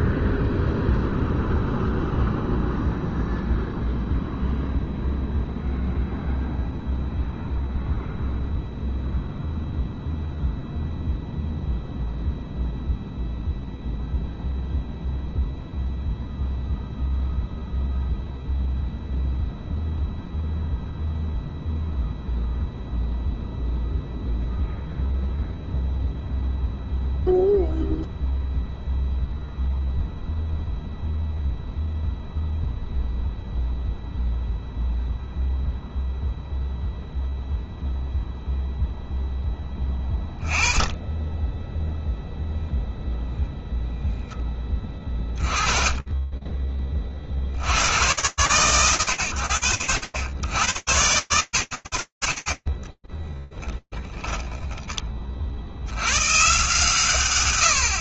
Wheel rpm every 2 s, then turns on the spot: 0, 0, 0, 0, 0, 0, 0, 0, 0, 0, 0, 0, 0, 0, 0, 0, 0, 0, 0, 0, 10, 10, 10, 20, 90, 80, 50, 10, 120.
none